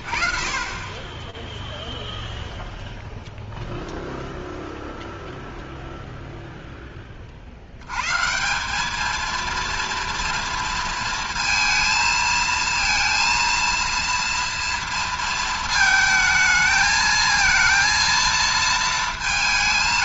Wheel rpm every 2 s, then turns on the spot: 0, 0, 0, 160, 230, 230, 230, 220, 230, 60.
18-20